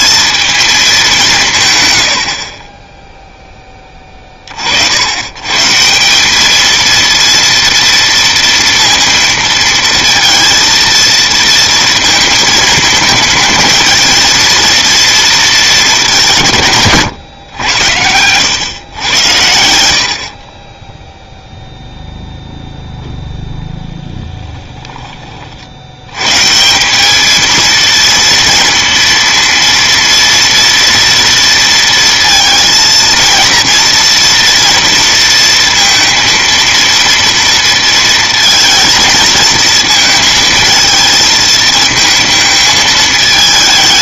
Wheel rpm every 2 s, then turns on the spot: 210, 40, 40, 210, 230, 230, 220, 230, 160, 110, 30, 0, 10, 150, 230, 230, 230, 230, 230, 230, 230, 220.
24-26